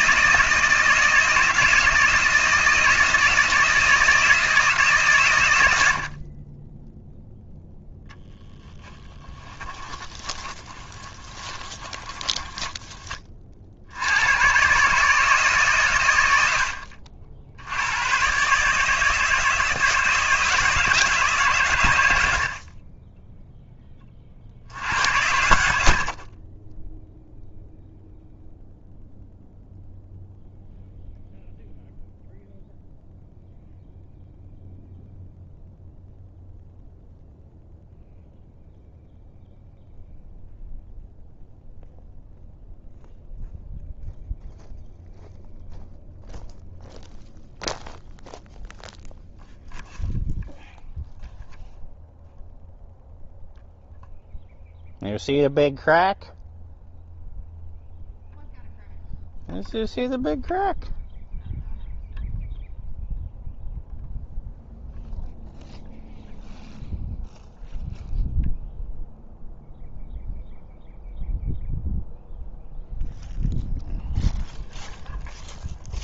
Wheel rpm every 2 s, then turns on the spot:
160, 160, 150, 10, 20, 20, 20, 140, 60, 150, 160, 30, 80, 10, 0, 0, 0, 0, 0, 0, 0, 0, 0, 0, 0, 0, 0, 0, 0, 0, 0, 0, 0, 0, 0, 0, 0, 0.
8-12